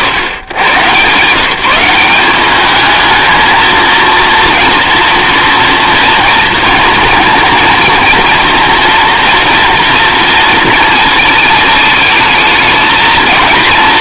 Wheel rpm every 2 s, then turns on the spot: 120, 210, 230, 230, 230, 220, 230.
none